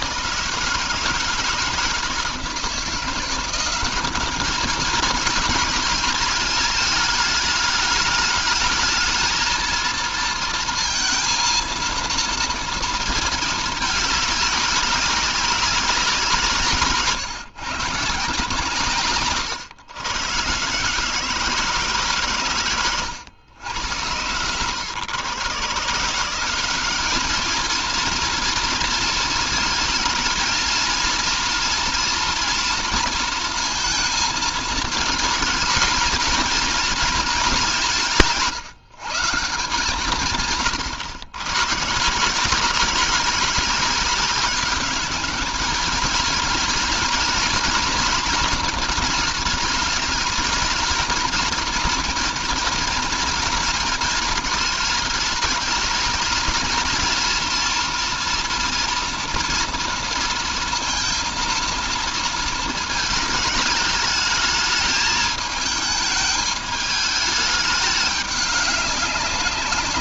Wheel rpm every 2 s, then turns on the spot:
160, 170, 220, 220, 220, 220, 230, 200, 140, 130, 150, 110, 110, 200, 230, 230, 230, 220, 230, 170, 130, 180, 210, 230, 230, 230, 240, 220, 230, 230, 230, 220, 220, 210, 180.
none